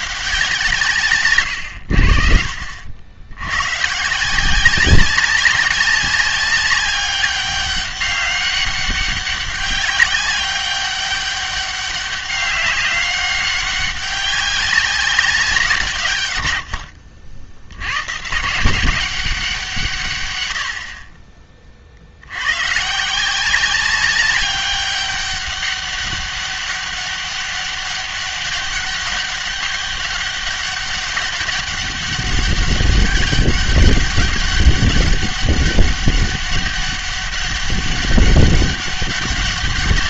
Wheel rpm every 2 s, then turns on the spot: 160, 60, 180, 200, 200, 200, 200, 190, 80, 170, 90, 120, 200, 200, 200, 200, 200, 200, 200, 200.
none